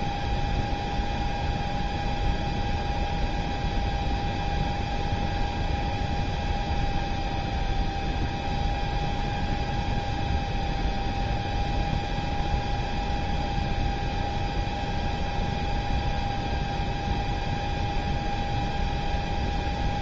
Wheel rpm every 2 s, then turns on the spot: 0, 0, 0, 0, 0, 0, 0, 0, 0, 0.
none